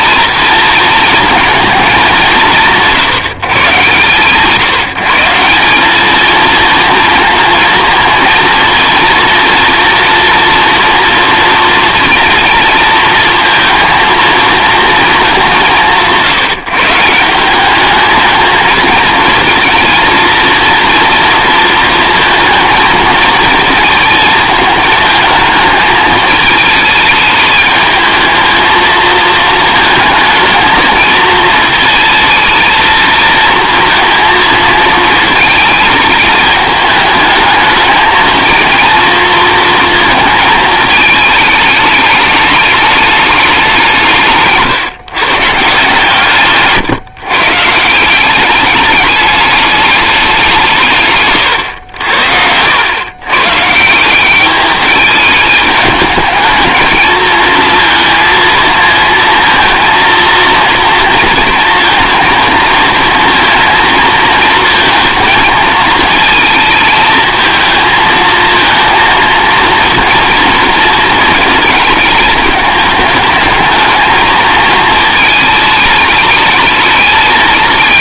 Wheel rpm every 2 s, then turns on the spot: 230, 120, 140, 230, 230, 230, 230, 230, 160, 220, 230, 220, 220, 220, 220, 220, 220, 230, 210, 220, 220, 210, 150, 140, 200, 170, 90, 200, 220, 230, 230, 230, 230, 220, 230, 230, 210, 220, 220.
none